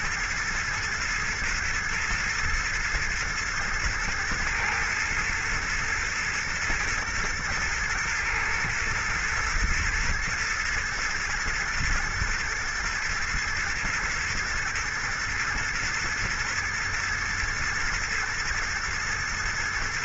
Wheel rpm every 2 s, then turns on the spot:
120, 110, 110, 110, 120, 110, 110, 120, 120, 120.
none